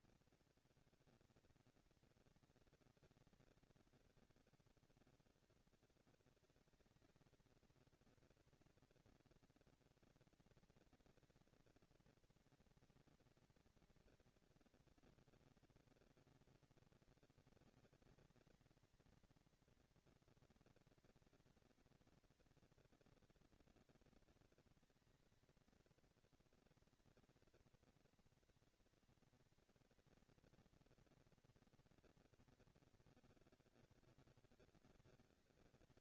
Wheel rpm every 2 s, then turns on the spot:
210, 190, 210, 220, 230, 230, 230, 240, 230, 220, 230, 230, 230, 230, 230, 230, 210, 190.
none